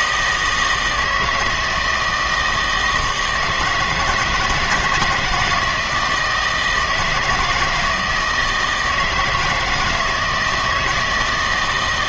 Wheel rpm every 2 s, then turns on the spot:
160, 160, 160, 170, 160, 160.
none